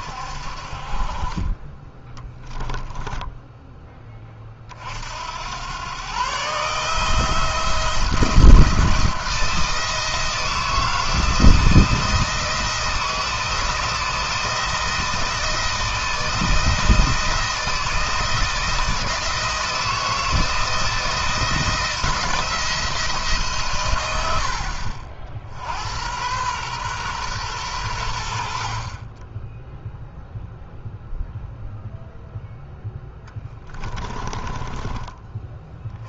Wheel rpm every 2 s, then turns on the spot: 40, 0, 50, 150, 170, 160, 160, 160, 170, 170, 160, 160, 60, 120, 50, 0, 10, 20.
none